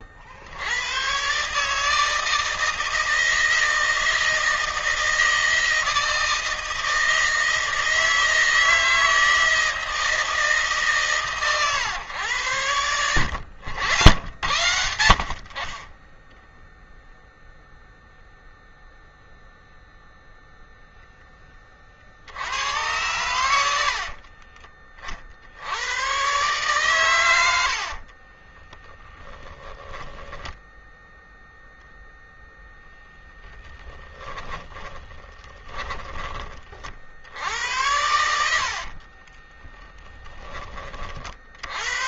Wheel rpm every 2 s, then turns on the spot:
110, 160, 160, 160, 160, 150, 90, 80, 0, 0, 0, 90, 40, 110, 20, 0, 0, 10, 50, 50, 40.
28-30 34-36 38-40